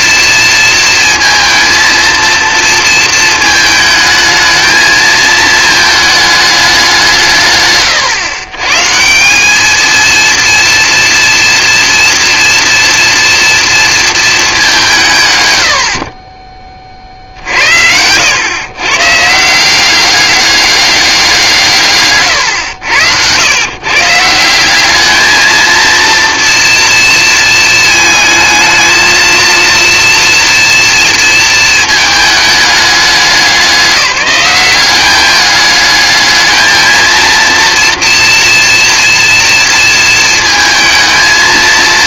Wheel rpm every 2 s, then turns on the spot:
230, 220, 220, 160, 180, 230, 240, 150, 60, 140, 190, 90, 220, 230, 220, 230, 200, 200, 230, 230, 220.
none